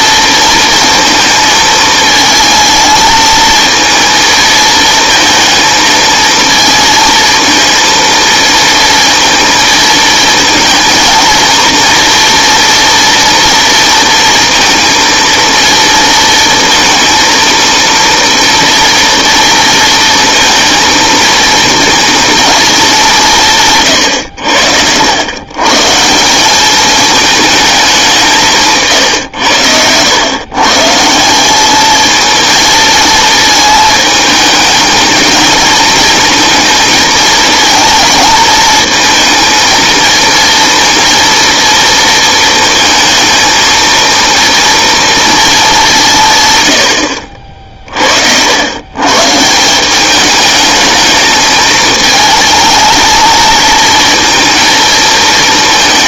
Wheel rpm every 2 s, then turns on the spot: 230, 220, 230, 230, 230, 230, 230, 230, 230, 230, 220, 160, 110, 220, 100, 190, 220, 220, 220, 220, 230, 230, 220, 50, 140, 210, 230, 220.
none